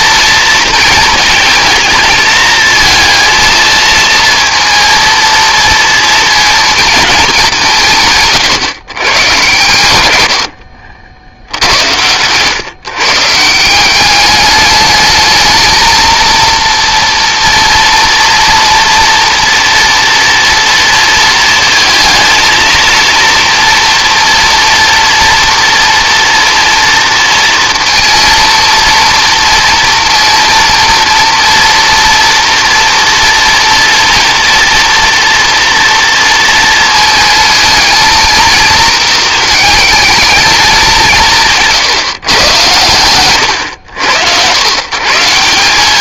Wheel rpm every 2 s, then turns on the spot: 220, 220, 230, 220, 120, 60, 130, 210, 230, 230, 230, 230, 230, 230, 230, 230, 230, 240, 230, 230, 190, 110, 140.
none